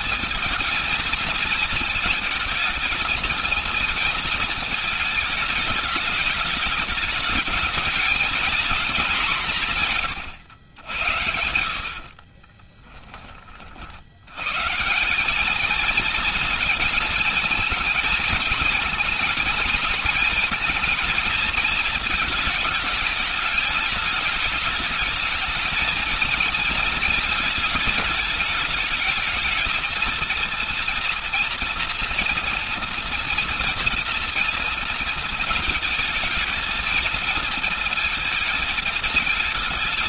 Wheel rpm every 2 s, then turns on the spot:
230, 230, 210, 210, 210, 80, 30, 200, 220, 220, 220, 210, 220, 230, 220, 230, 230, 220, 220, 210.
10-12